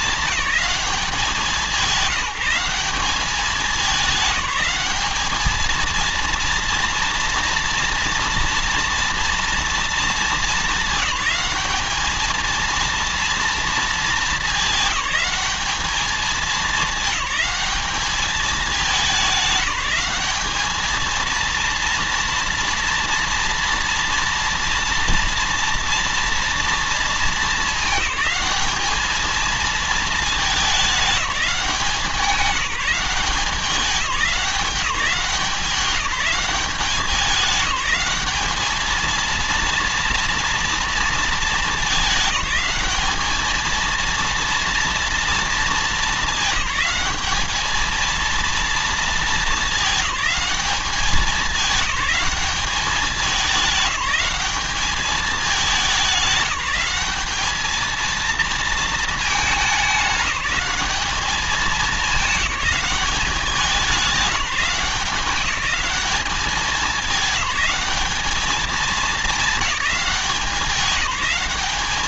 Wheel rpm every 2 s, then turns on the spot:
180, 190, 210, 230, 230, 220, 230, 210, 190, 210, 220, 230, 230, 220, 220, 200, 180, 190, 200, 220, 220, 220, 230, 210, 220, 200, 190, 210, 210, 220, 210, 180, 170, 210, 200, 180.
none